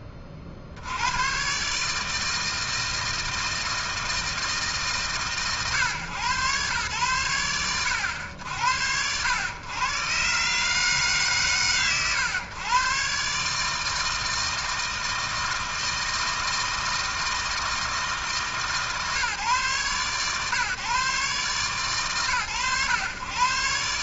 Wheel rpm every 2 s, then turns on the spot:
80, 160, 150, 100, 90, 130, 130, 160, 160, 150, 130, 120.
none